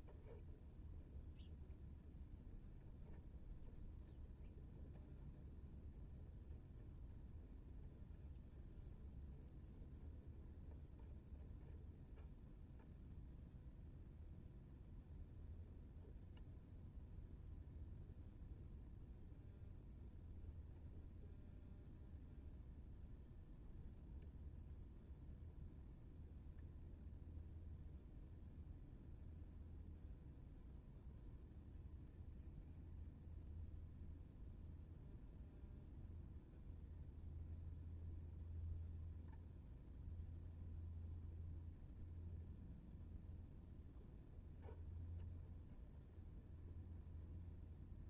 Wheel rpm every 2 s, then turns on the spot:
0, 0, 0, 0, 0, 0, 0, 0, 0, 0, 0, 0, 0, 0, 0, 0, 0, 0, 0, 0, 0, 0, 0, 0.
none